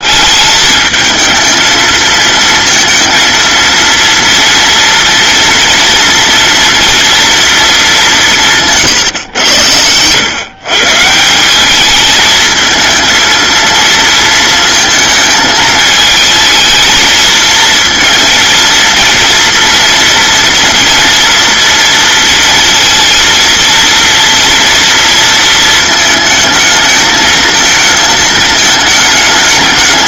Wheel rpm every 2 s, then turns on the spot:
210, 230, 230, 230, 160, 140, 220, 220, 220, 230, 230, 230, 230, 220, 220.
none